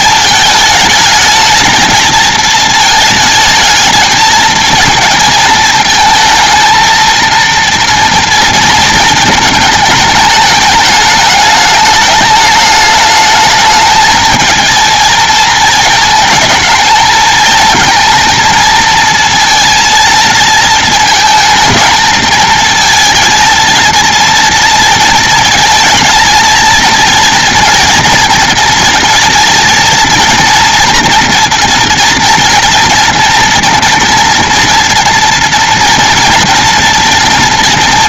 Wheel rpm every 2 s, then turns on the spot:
220, 230, 230, 230, 230, 210, 210, 220, 220, 220, 220, 220, 230, 230, 230, 230, 230, 240, 240.
none